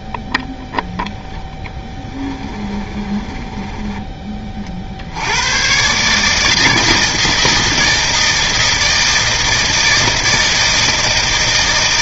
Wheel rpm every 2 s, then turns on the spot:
10, 10, 50, 160, 160, 160.
2-4